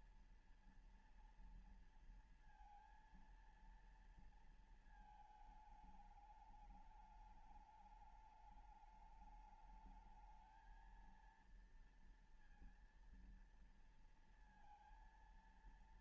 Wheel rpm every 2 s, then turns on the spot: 230, 230, 220, 210, 210, 220, 230, 230.
none